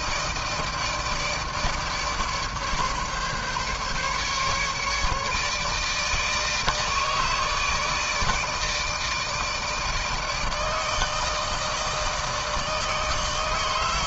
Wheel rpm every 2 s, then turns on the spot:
160, 150, 150, 160, 160, 160, 160.
none